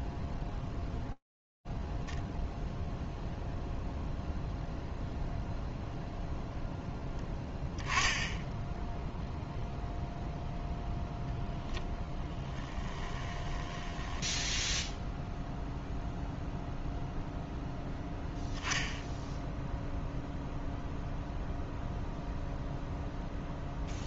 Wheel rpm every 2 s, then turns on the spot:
0, 0, 0, 0, 0, 0, 10, 0, 0, 0, 0, 0.
12-14